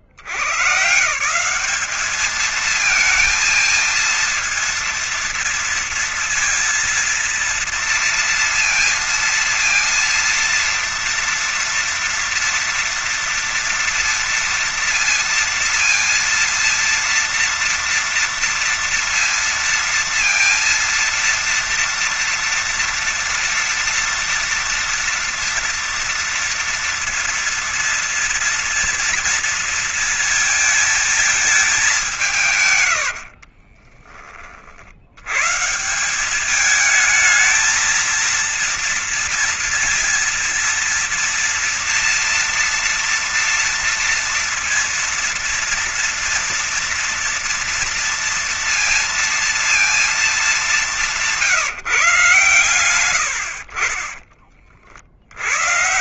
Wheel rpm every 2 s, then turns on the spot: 60, 200, 220, 230, 230, 230, 230, 230, 230, 230, 230, 230, 230, 230, 230, 230, 170, 30, 180, 230, 230, 230, 240, 240, 230, 220, 140, 30.
none